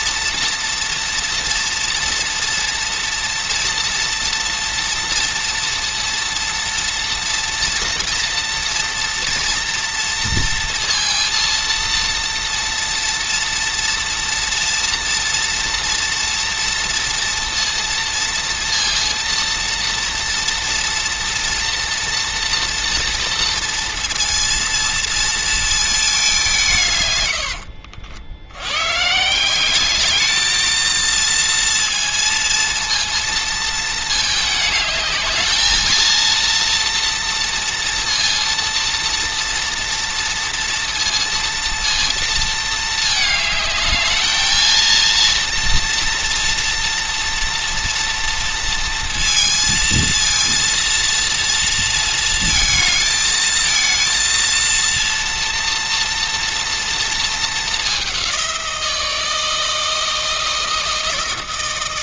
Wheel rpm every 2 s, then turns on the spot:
230, 230, 240, 230, 230, 230, 230, 240, 230, 230, 230, 230, 230, 120, 130, 230, 230, 210, 230, 230, 230, 220, 230, 240, 230, 230, 220, 230, 230, 170, 160.
26-28